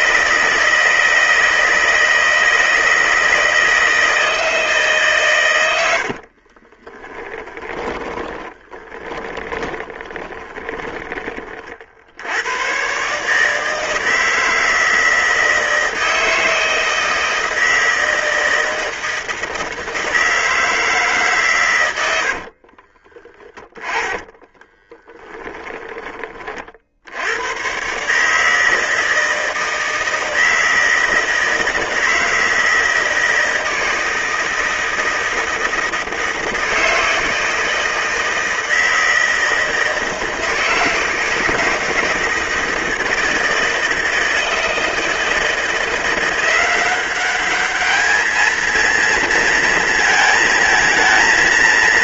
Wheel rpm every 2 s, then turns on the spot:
160, 160, 140, 10, 20, 20, 140, 160, 160, 160, 150, 20, 20, 70, 160, 160, 160, 160, 160, 160, 160, 160, 160, 190, 230, 230.
6-10 22-26